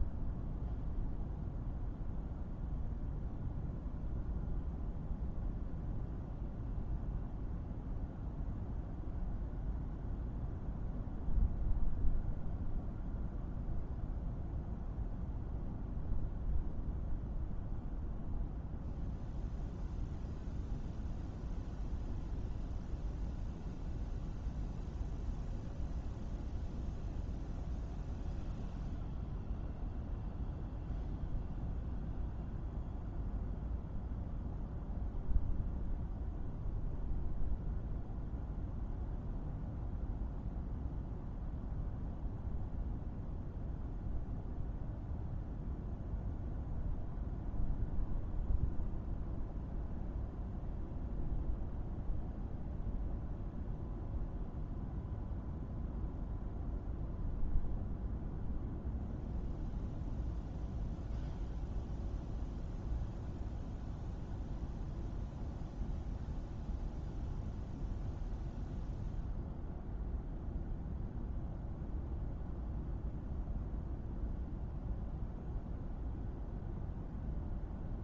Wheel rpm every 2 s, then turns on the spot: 0, 0, 0, 0, 0, 0, 0, 0, 0, 0, 0, 0, 0, 0, 0, 0, 0, 0, 0, 0, 0, 0, 0, 0, 0, 0, 0, 0, 0, 0, 0, 0, 0, 0, 0, 0, 0, 0, 0.
none